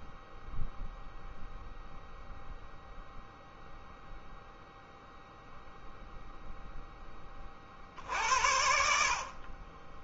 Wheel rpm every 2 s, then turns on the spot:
0, 0, 0, 20, 60.
none